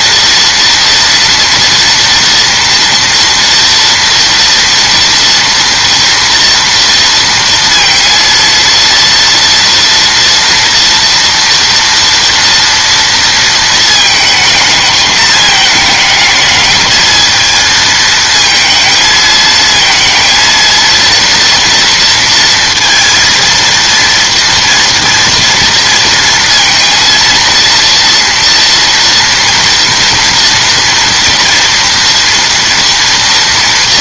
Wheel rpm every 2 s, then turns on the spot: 230, 230, 230, 230, 230, 230, 230, 220, 220, 220, 230, 230, 240, 230, 230, 230, 230.
none